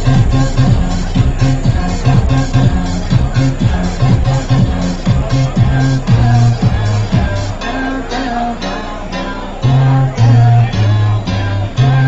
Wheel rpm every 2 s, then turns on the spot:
0, 0, 0, 0, 0, 0.
none